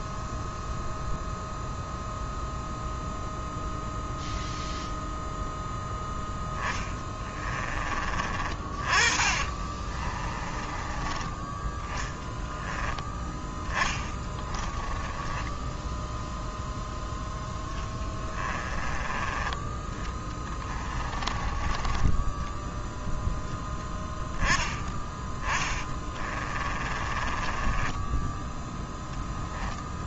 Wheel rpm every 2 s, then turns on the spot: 0, 0, 0, 20, 30, 20, 10, 10, 0, 20, 20, 0, 10, 30, 20.
6-8 10-12 14-16 18-22 26-30